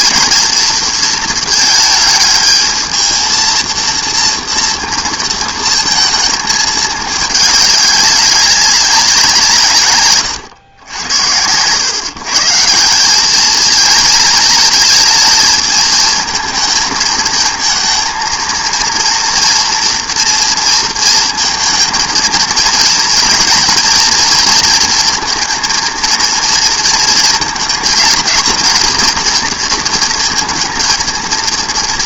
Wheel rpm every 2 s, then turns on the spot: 230, 220, 230, 210, 190, 110, 150, 220, 220, 230, 230, 230, 230, 230, 230, 230.
none